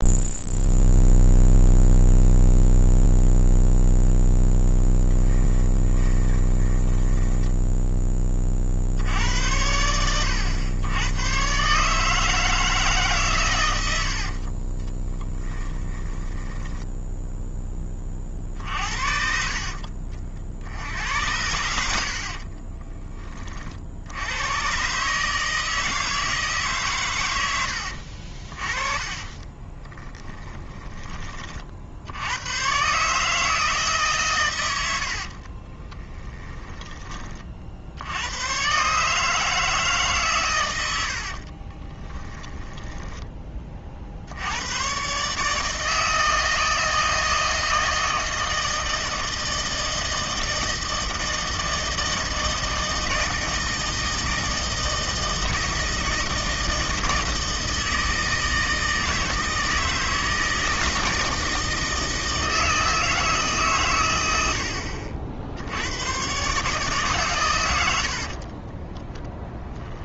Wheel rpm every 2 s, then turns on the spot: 0, 0, 10, 10, 10, 100, 150, 30, 10, 50, 80, 30, 130, 140, 30, 20, 140, 90, 30, 140, 90, 10, 120, 160, 160, 160, 160, 160, 160, 160, 160, 160, 70, 150, 20.
4-8 14-18 22-24 28-30 34-38 42-44 68-70